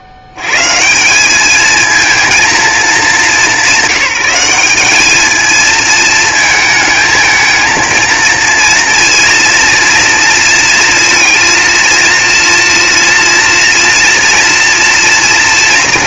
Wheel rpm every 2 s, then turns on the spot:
70, 220, 200, 220, 230, 230, 230, 240.
none